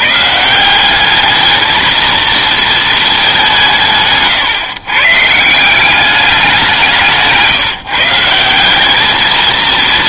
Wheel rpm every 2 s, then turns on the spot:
170, 230, 140, 180, 190.
none